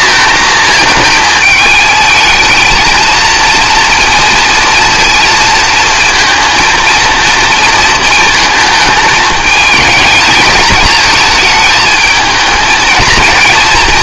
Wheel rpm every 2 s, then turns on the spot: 230, 220, 230, 230, 220, 220, 220.
none